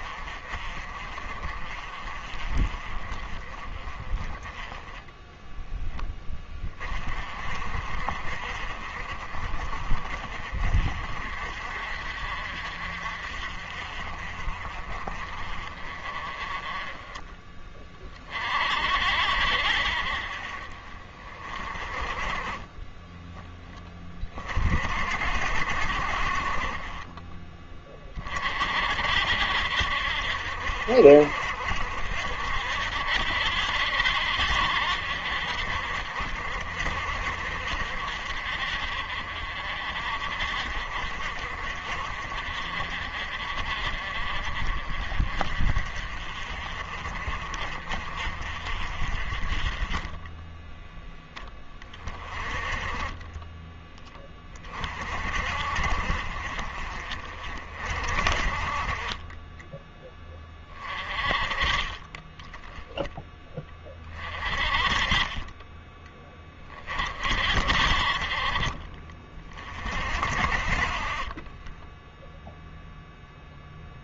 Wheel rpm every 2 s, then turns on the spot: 40, 30, 10, 30, 40, 40, 50, 40, 20, 50, 30, 20, 50, 30, 50, 60, 60, 70, 50, 50, 50, 40, 40, 40, 40, 10, 20, 30, 40, 30, 30, 10, 30, 30, 30, 40, 0.
22-24